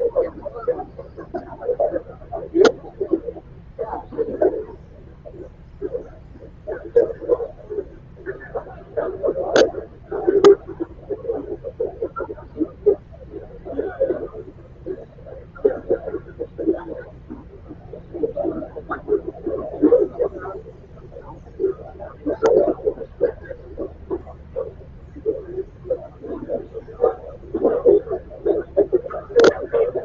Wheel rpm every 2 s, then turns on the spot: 0, 0, 0, 0, 0, 0, 0, 0, 0, 0, 0, 0, 0, 0, 0.
none